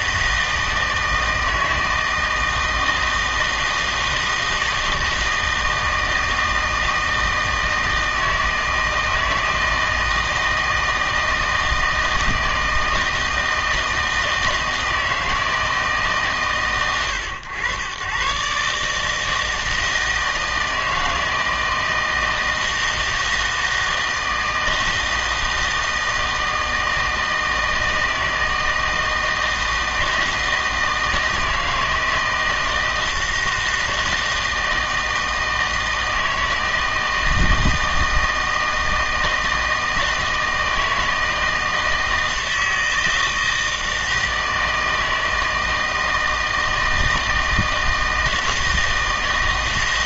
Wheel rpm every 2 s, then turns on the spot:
160, 160, 160, 160, 160, 160, 160, 160, 130, 140, 160, 160, 160, 160, 160, 160, 170, 160, 160, 160, 160, 160, 160, 160, 160.
none